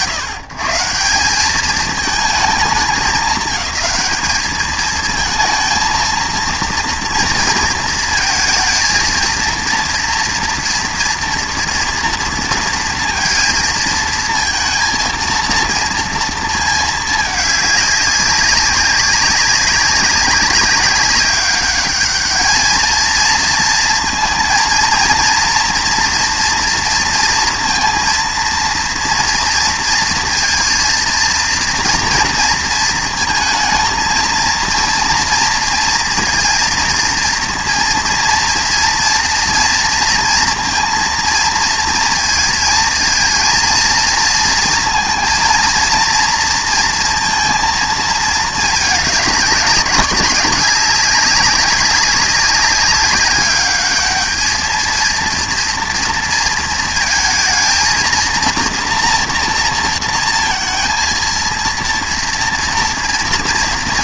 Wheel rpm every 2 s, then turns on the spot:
150, 210, 210, 230, 230, 240, 230, 230, 220, 200, 200, 220, 230, 240, 230, 230, 230, 230, 230, 230, 230, 230, 230, 230, 210, 200, 200, 220, 230, 240, 230, 230.
none